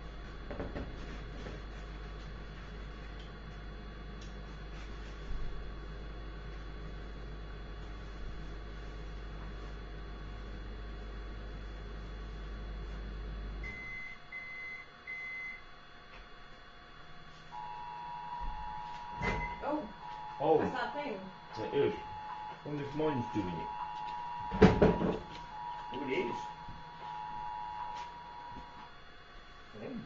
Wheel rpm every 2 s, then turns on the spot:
0, 0, 0, 0, 0, 0, 0, 0, 0, 0, 0, 0, 0, 0, 0.
none